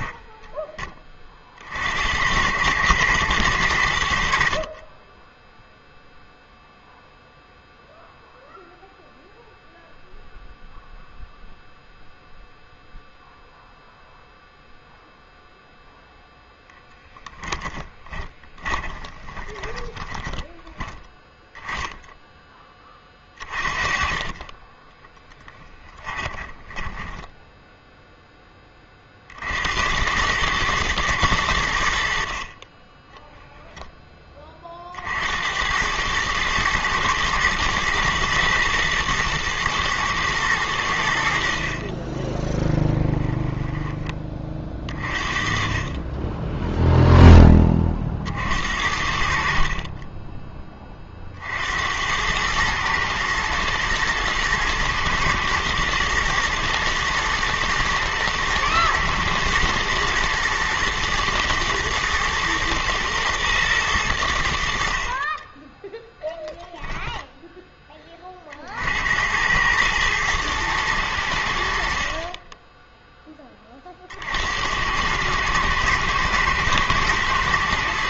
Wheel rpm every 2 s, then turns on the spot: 10, 100, 40, 0, 0, 0, 0, 0, 0, 20, 10, 10, 20, 20, 20, 110, 30, 20, 110, 110, 100, 10, 30, 0, 60, 20, 110, 120, 110, 110, 110, 110, 60, 0, 40, 110, 10, 80, 110.
18-20 26-28 42-44